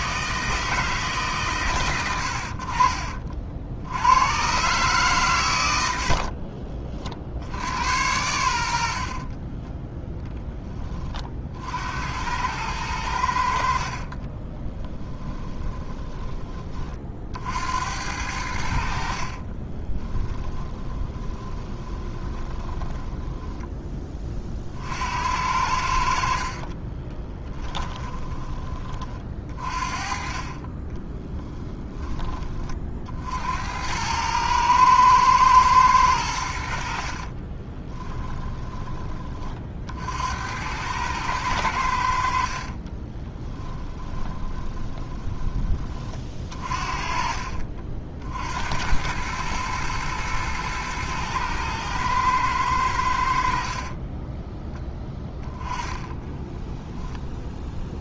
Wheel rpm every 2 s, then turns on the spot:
160, 60, 130, 40, 80, 10, 100, 40, 40, 70, 20, 10, 50, 30, 20, 20, 30, 110, 70, 20, 90, 40, 20, 40, 80, 110, 100, 10, 10.
6-8 14-16 20-24 26-28 42-46 56-58